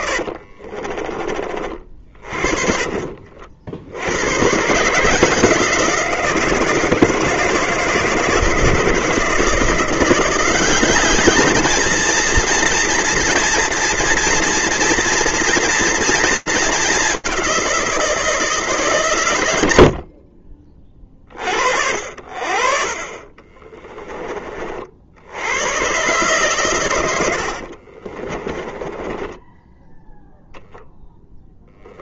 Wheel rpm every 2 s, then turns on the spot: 40, 40, 130, 160, 160, 190, 230, 230, 220, 150, 30, 50, 40, 130, 20, 10.
0-4 28-30